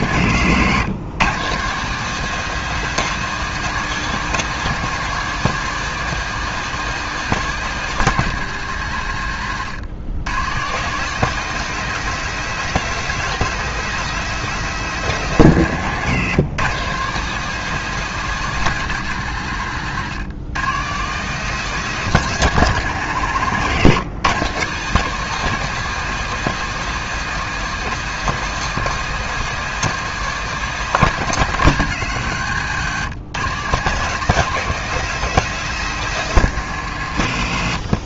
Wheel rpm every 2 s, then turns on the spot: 130, 200, 190, 190, 150, 160, 200, 190, 150, 180, 150, 170, 170, 200, 190, 190, 140, 200, 140.
none